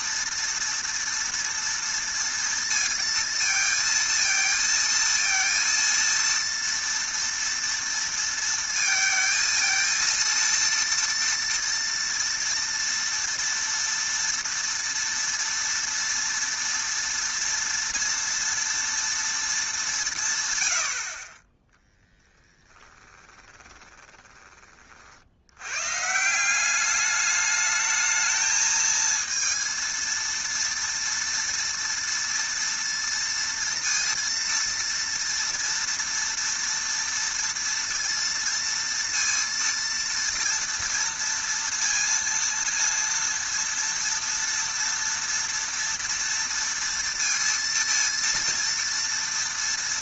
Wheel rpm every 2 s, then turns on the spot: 230, 230, 230, 230, 230, 230, 230, 230, 230, 230, 120, 10, 20, 190, 220, 230, 230, 230, 230, 230, 230, 230, 230, 230, 230.
22-24